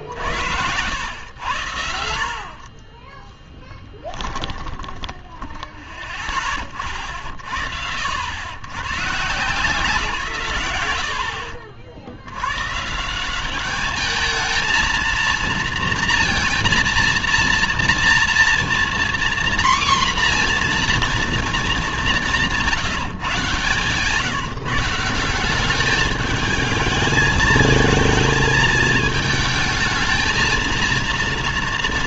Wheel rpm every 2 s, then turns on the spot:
100, 30, 20, 60, 130, 90, 150, 220, 230, 240, 240, 150, 180, 220, 220, 230.
4-6